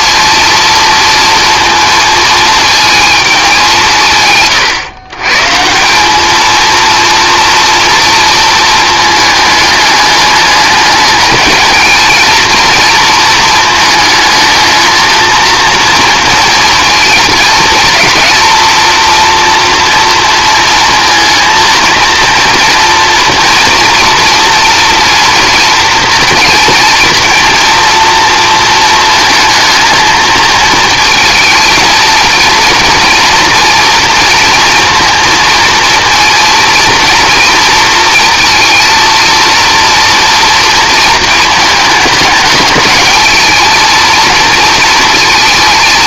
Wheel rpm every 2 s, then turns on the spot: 230, 230, 130, 220, 220, 210, 230, 220, 230, 230, 230, 230, 230, 230, 230, 220, 230, 230, 230, 230, 230, 210, 230.
none